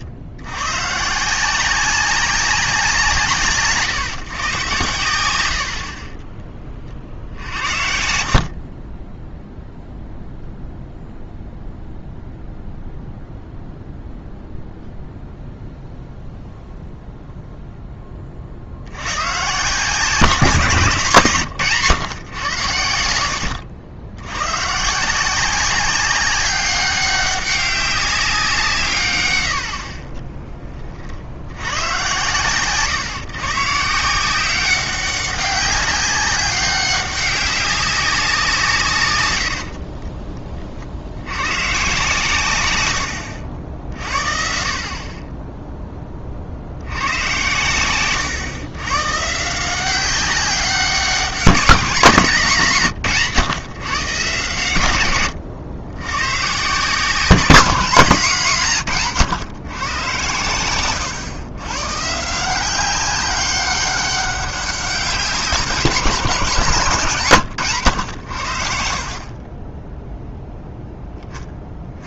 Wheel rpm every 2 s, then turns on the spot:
110, 180, 120, 30, 40, 0, 0, 0, 0, 50, 160, 100, 130, 200, 170, 30, 120, 190, 190, 160, 40, 110, 50, 70, 120, 190, 160, 110, 140, 170, 110, 180, 200, 170, 70, 0.
none